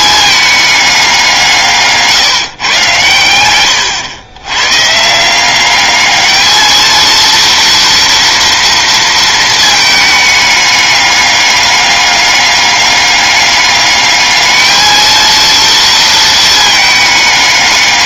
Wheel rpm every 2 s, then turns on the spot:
200, 140, 120, 220, 230, 210, 200, 220, 220.
none